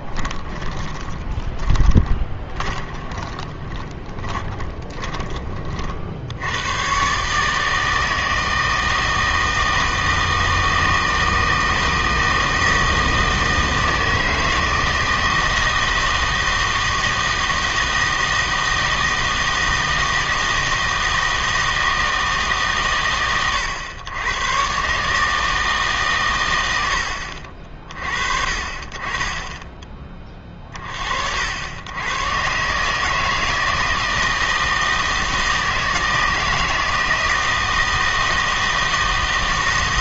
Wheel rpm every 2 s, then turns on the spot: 30, 20, 20, 110, 160, 160, 160, 160, 160, 160, 160, 140, 130, 100, 30, 40, 140, 160, 160, 160.
0-6